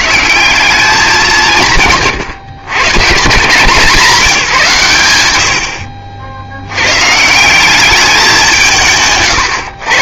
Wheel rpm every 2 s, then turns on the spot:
170, 130, 160, 110, 190.
none